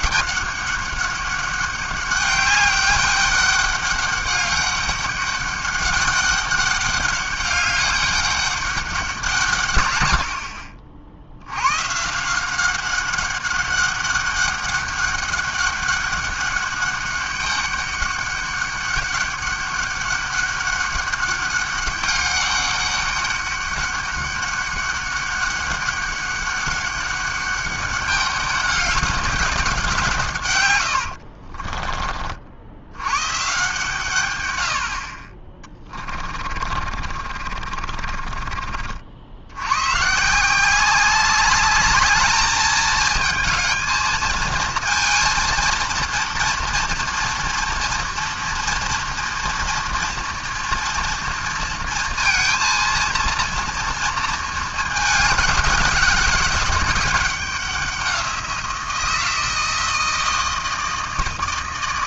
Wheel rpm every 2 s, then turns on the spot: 200, 200, 200, 200, 200, 70, 190, 200, 200, 200, 200, 200, 200, 200, 200, 110, 80, 80, 40, 50, 180, 220, 220, 230, 230, 240, 230, 220, 200, 170, 160.
36-38